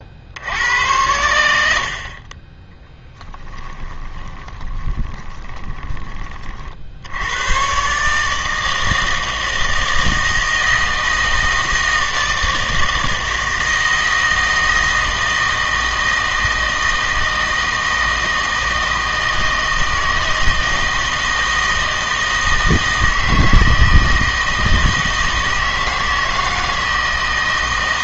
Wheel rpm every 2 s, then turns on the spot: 90, 20, 20, 50, 160, 160, 160, 160, 160, 160, 160, 160, 160, 160.
4-6